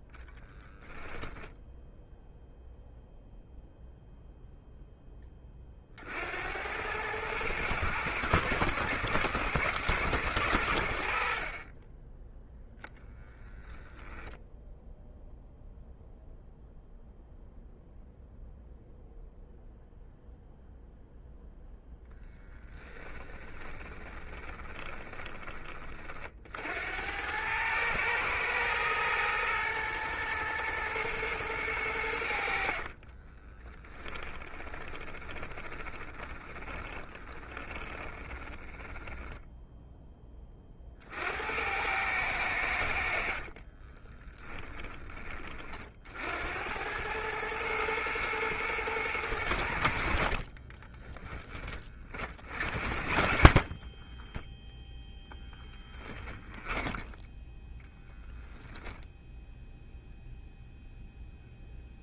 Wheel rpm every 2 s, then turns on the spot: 10, 0, 10, 100, 120, 80, 10, 0, 0, 0, 0, 20, 20, 80, 110, 120, 40, 20, 20, 10, 50, 70, 20, 100, 110, 20, 50, 0, 10, 10, 0.
22-26 32-40 50-54 56-58